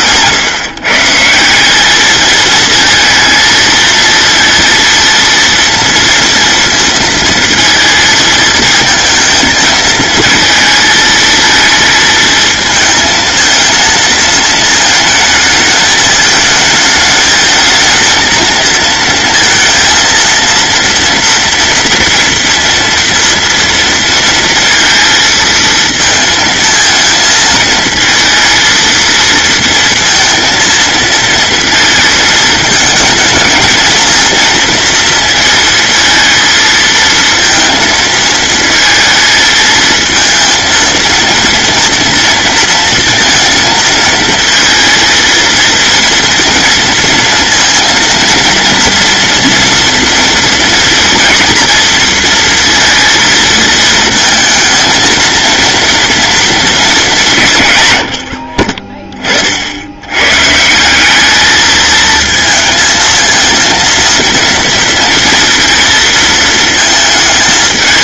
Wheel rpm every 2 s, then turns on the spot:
150, 230, 230, 230, 220, 220, 220, 220, 220, 230, 230, 230, 230, 220, 230, 230, 220, 230, 230, 220, 230, 230, 230, 230, 230, 230, 230, 220, 200, 20, 180, 220, 230, 220.
none